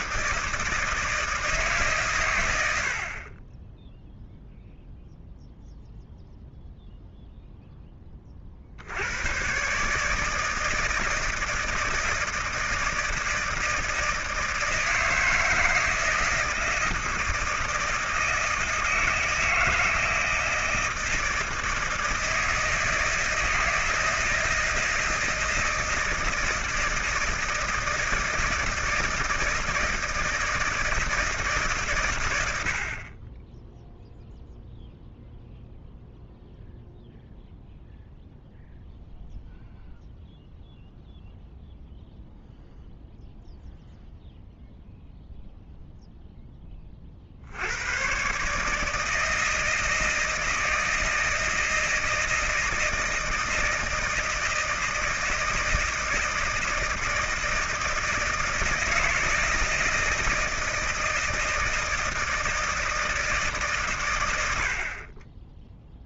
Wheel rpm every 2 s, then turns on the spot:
160, 100, 0, 0, 30, 160, 160, 160, 160, 160, 160, 160, 160, 170, 160, 160, 80, 0, 0, 0, 0, 0, 0, 10, 140, 160, 160, 160, 160, 160, 160, 160, 80.
none